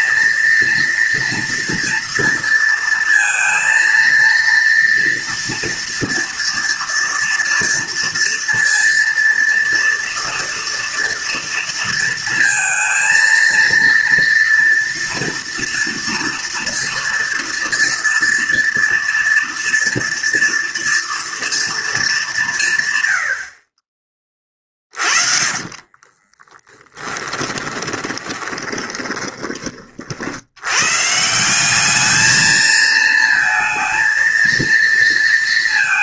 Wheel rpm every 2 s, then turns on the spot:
240, 230, 230, 230, 230, 240, 230, 230, 230, 230, 240, 130, 20, 10, 20, 120, 220, 230.
24-30